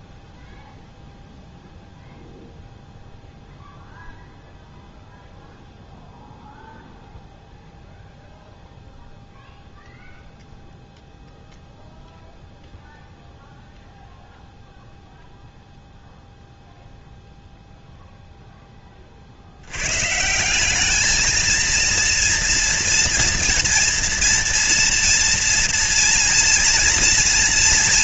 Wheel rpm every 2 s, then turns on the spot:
0, 0, 0, 0, 0, 0, 0, 0, 0, 10, 180, 230, 230, 230.
none